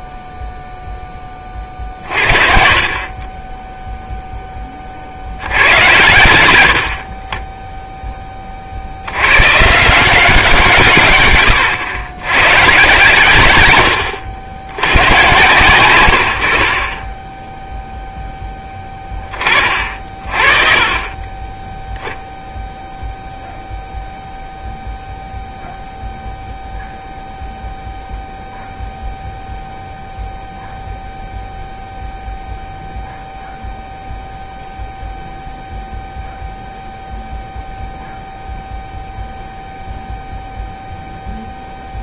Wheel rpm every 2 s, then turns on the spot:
0, 40, 20, 80, 50, 140, 130, 60, 60, 10, 40, 0, 0, 0, 0, 0, 0, 0, 0, 0, 0.
none